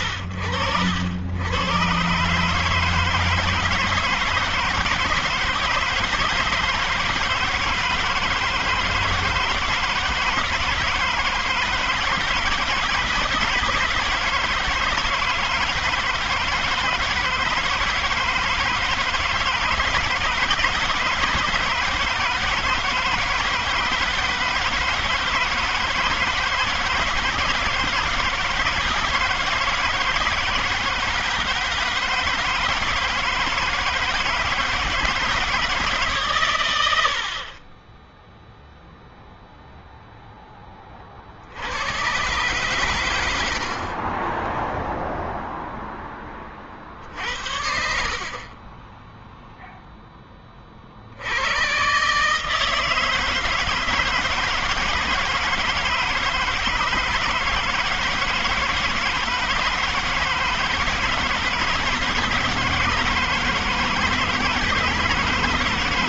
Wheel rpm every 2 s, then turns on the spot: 100, 160, 160, 160, 160, 160, 160, 160, 160, 160, 160, 160, 160, 160, 160, 160, 160, 160, 130, 0, 10, 120, 10, 30, 30, 10, 140, 160, 160, 170, 160, 160, 160.
none